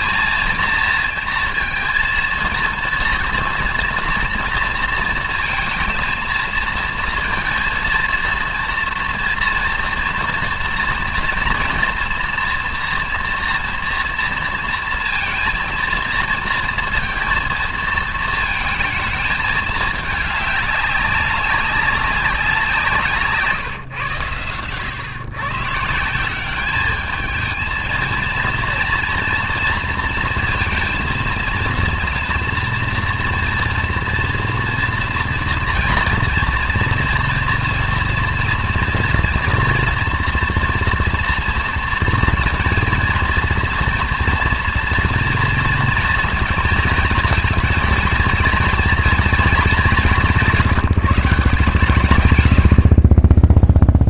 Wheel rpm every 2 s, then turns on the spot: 230, 230, 230, 230, 230, 230, 230, 230, 230, 220, 200, 160, 100, 200, 230, 230, 230, 240, 230, 230, 230, 230, 230, 230, 240, 180, 70.
none